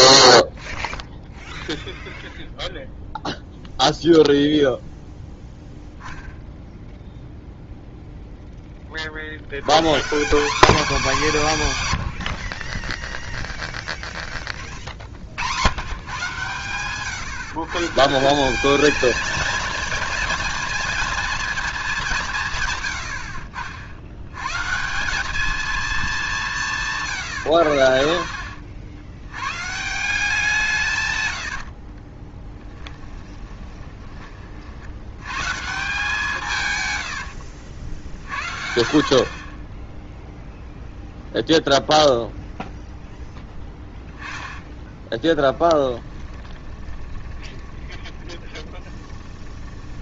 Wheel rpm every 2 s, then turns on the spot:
0, 0, 0, 0, 20, 230, 30, 30, 130, 210, 230, 110, 160, 160, 70, 160, 10, 60, 120, 50, 0, 0, 20, 10, 20.
32-34 44-50